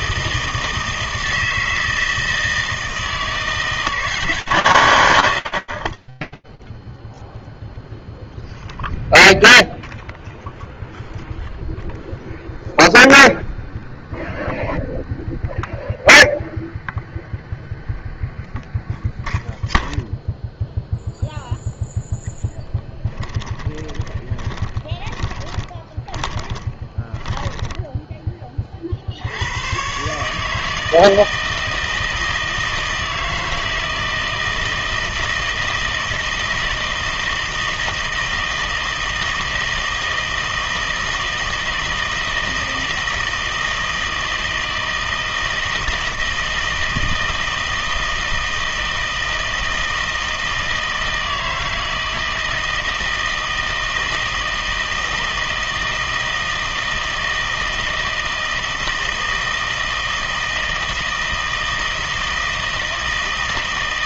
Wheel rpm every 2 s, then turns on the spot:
160, 160, 130, 0, 0, 0, 0, 0, 0, 0, 0, 20, 20, 10, 80, 160, 160, 160, 160, 160, 160, 160, 160, 160, 160, 160, 160, 160, 160, 160, 160, 160.
22-28